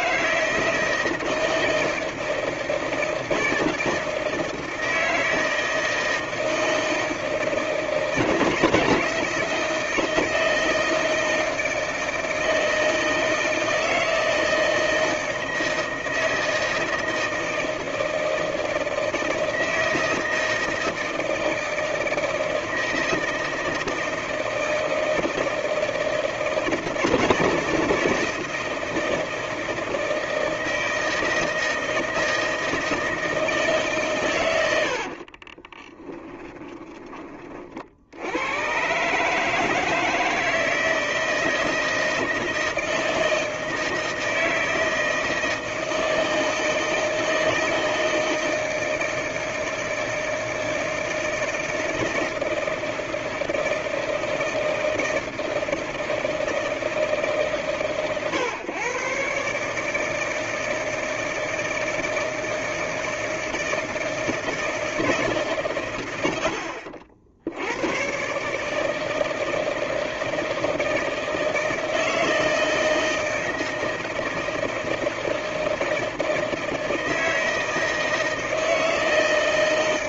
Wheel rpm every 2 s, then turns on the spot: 160, 160, 160, 160, 160, 160, 160, 160, 160, 160, 160, 160, 160, 160, 160, 160, 160, 110, 20, 100, 160, 160, 160, 160, 160, 160, 160, 160, 160, 120, 160, 160, 160, 80, 140, 160, 160, 160, 160, 160.
36-38